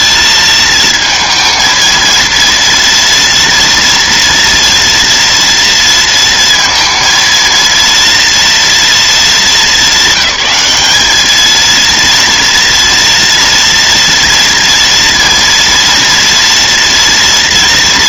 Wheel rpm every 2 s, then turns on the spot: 230, 230, 240, 230, 230, 210, 230, 230, 230.
none